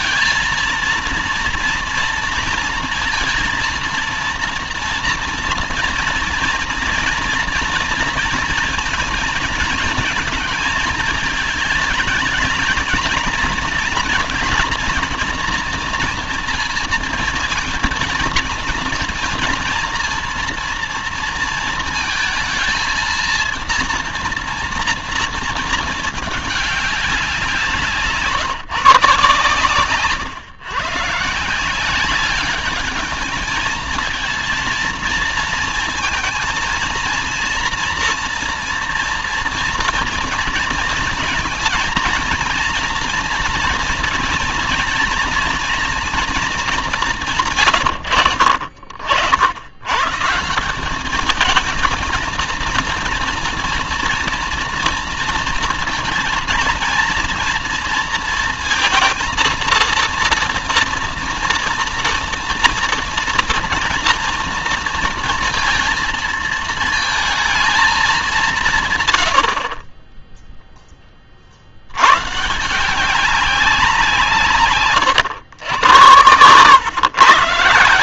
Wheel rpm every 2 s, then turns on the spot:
230, 230, 230, 230, 230, 220, 220, 230, 230, 230, 230, 230, 230, 190, 140, 140, 210, 230, 230, 230, 220, 230, 230, 180, 70, 200, 230, 230, 230, 230, 230, 230, 230, 230, 140, 20, 180, 130, 110.
none